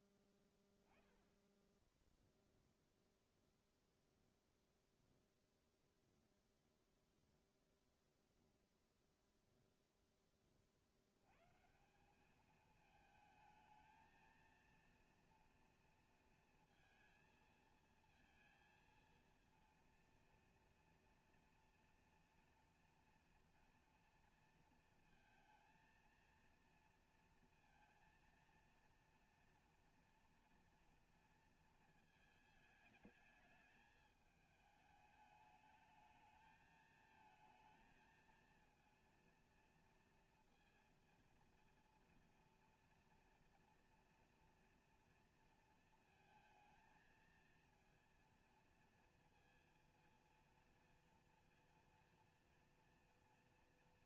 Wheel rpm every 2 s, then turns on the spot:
0, 0, 0, 0, 0, 180, 220, 230, 230, 230, 240, 230, 230, 230, 230, 220, 210, 210, 220, 230, 230, 230, 230, 230, 230, 230, 230.
none